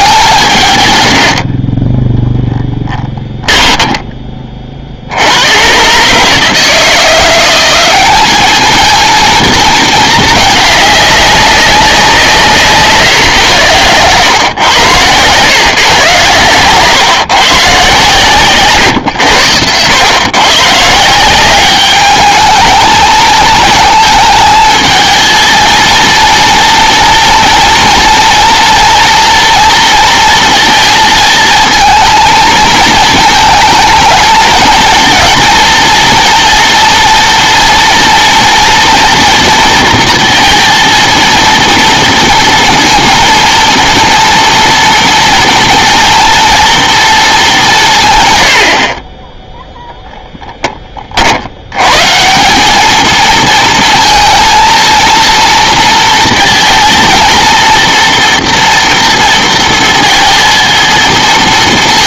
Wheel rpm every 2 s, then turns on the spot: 130, 10, 50, 160, 220, 210, 160, 110, 130, 120, 150, 220, 220, 230, 230, 230, 220, 230, 240, 230, 230, 230, 230, 230, 60, 30, 200, 230, 230, 230, 230.
2-4 14-16